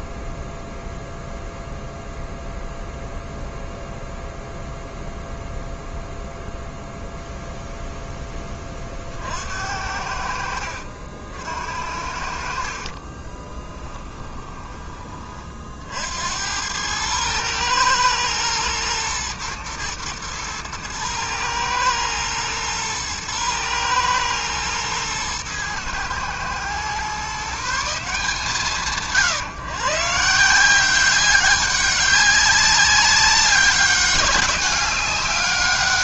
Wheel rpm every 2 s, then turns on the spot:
0, 0, 0, 0, 50, 60, 30, 20, 100, 120, 110, 120, 120, 130, 120, 190, 200, 200.
12-14